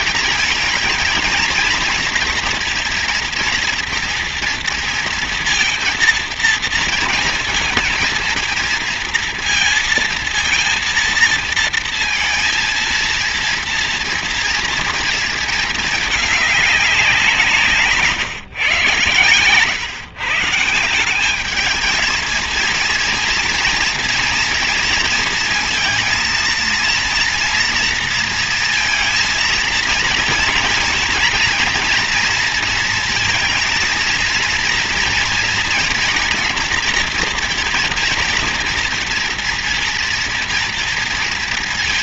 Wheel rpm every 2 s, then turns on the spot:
220, 230, 230, 230, 230, 230, 230, 230, 190, 120, 190, 240, 230, 230, 230, 230, 230, 230, 230, 230, 230.
none